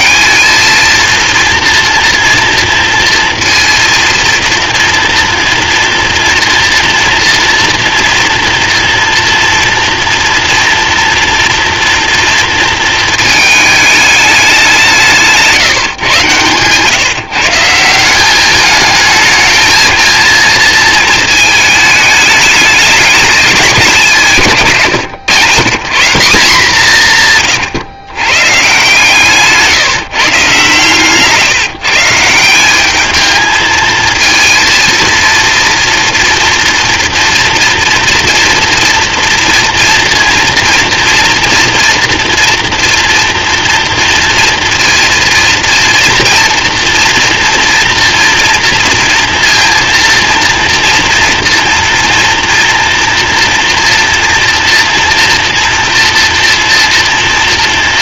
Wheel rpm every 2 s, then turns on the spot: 220, 230, 230, 240, 230, 230, 230, 180, 130, 210, 230, 210, 140, 190, 140, 140, 180, 230, 240, 230, 230, 230, 230, 230, 230, 230, 240, 230, 230.
24-26